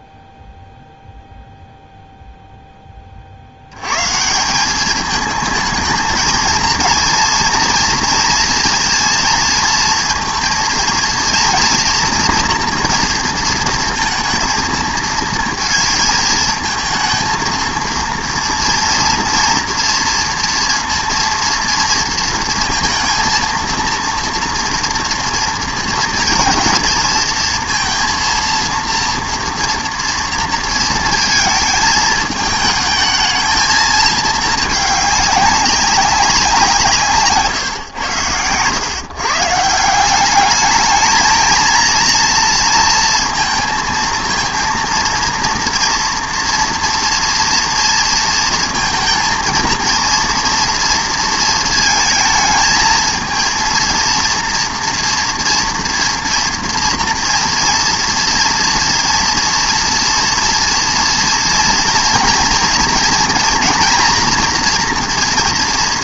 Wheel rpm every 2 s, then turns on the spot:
0, 0, 180, 230, 230, 230, 240, 230, 220, 230, 230, 230, 230, 230, 230, 230, 210, 210, 170, 110, 210, 230, 230, 240, 230, 230, 220, 230, 230, 230, 240, 230, 230.
none